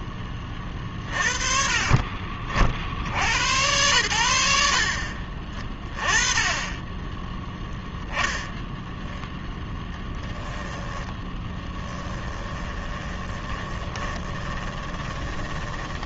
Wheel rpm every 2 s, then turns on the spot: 30, 60, 50, 20, 0, 10, 20, 20.
10-16